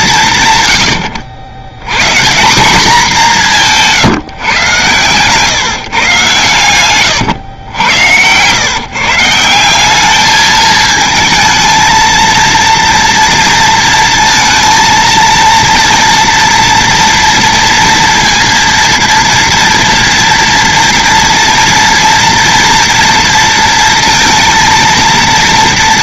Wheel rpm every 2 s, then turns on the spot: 100, 200, 130, 120, 170, 220, 230, 230, 230, 230, 230, 230, 230.
6-8